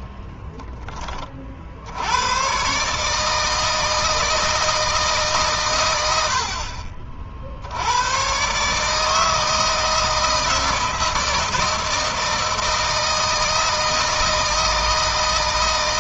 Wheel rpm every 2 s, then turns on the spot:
20, 140, 160, 50, 140, 160, 160, 160.
none